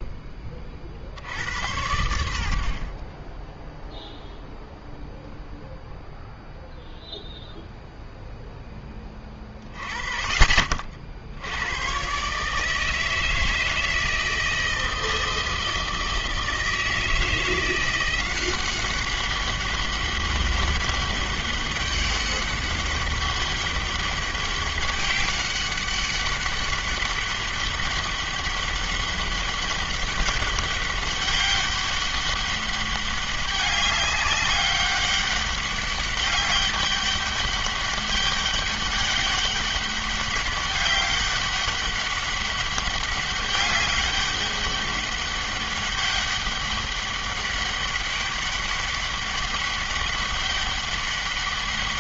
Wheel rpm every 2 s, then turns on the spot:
60, 30, 0, 0, 20, 60, 160, 160, 160, 190, 200, 200, 200, 200, 200, 200, 200, 200, 200, 200, 200, 200, 200, 200, 200, 200.
none